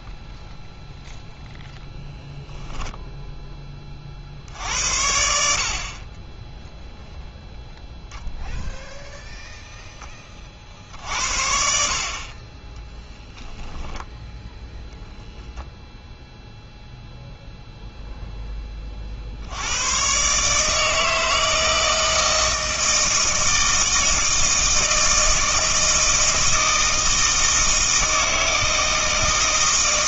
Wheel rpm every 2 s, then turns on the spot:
0, 0, 70, 0, 0, 50, 20, 0, 0, 30, 160, 160, 160, 160, 160.
none